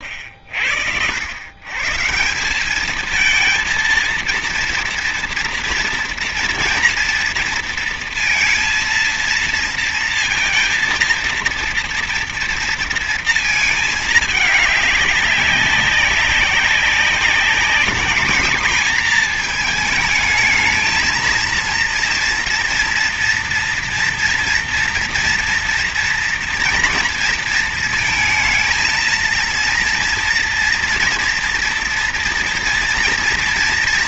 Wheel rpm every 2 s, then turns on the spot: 80, 190, 230, 230, 230, 230, 230, 210, 200, 230, 220, 230, 230, 230, 230, 230, 230.
none